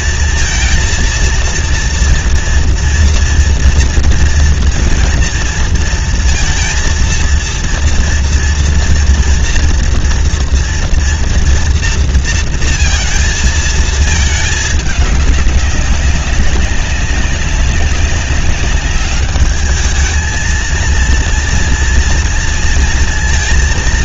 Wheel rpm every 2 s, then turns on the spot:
230, 240, 230, 230, 230, 230, 230, 210, 200, 200, 220, 230.
none